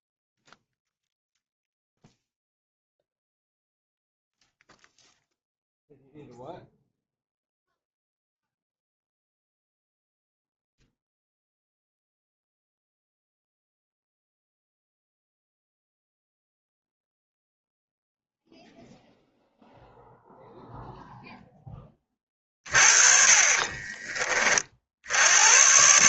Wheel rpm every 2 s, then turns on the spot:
0, 0, 0, 0, 0, 0, 0, 0, 0, 0, 0, 40, 50.
22-24